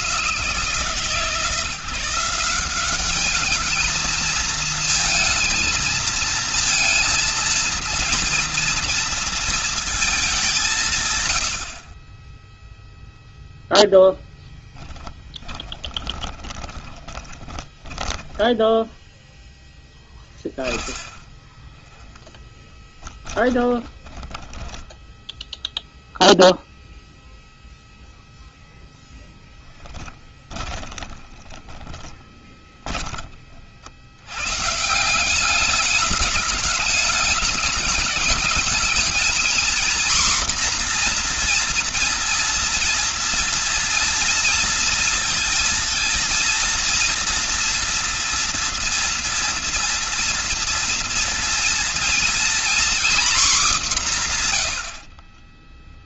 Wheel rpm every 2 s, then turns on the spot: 160, 190, 230, 230, 240, 170, 10, 10, 20, 10, 20, 10, 20, 0, 0, 20, 20, 130, 210, 200, 240, 240, 230, 230, 230, 230, 240, 110.
12-26 30-34